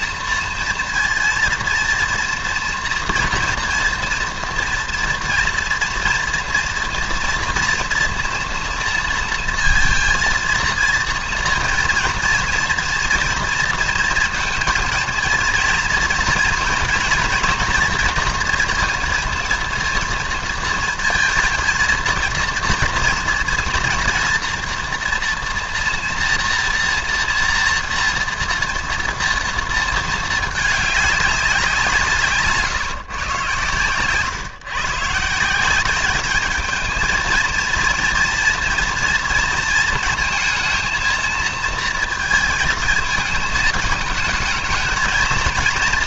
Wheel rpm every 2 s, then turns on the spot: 230, 240, 230, 230, 230, 230, 230, 230, 230, 230, 230, 230, 240, 230, 230, 220, 150, 140, 210, 230, 230, 230, 210.
none